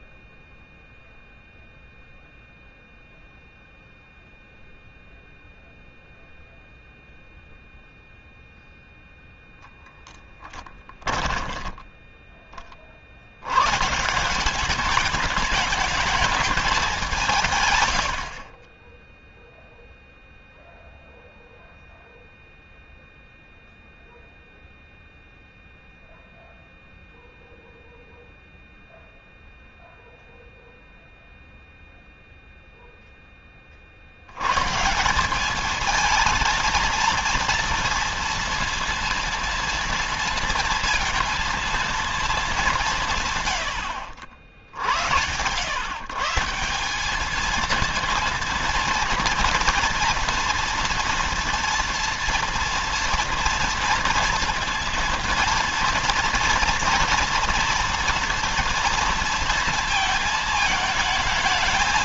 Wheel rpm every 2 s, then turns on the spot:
0, 0, 0, 0, 0, 10, 30, 180, 210, 50, 0, 0, 0, 0, 0, 0, 0, 110, 230, 230, 230, 210, 60, 170, 230, 230, 230, 230, 230, 230, 220.
10-12